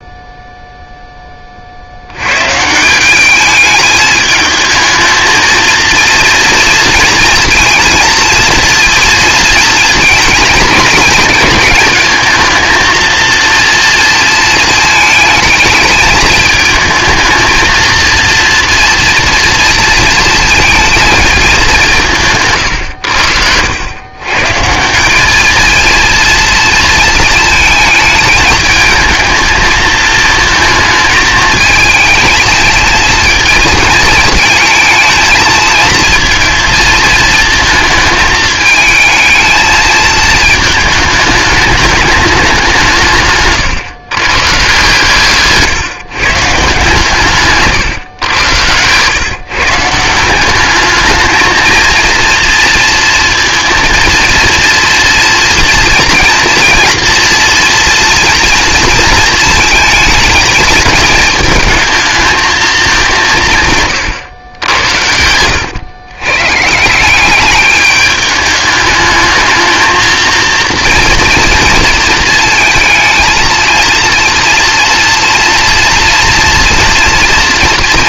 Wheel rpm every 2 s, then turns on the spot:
0, 160, 220, 230, 230, 220, 220, 220, 220, 230, 230, 120, 150, 230, 220, 230, 220, 220, 230, 220, 220, 180, 140, 150, 110, 200, 230, 230, 230, 230, 220, 210, 90, 150, 210, 230, 220, 230, 240.
48-50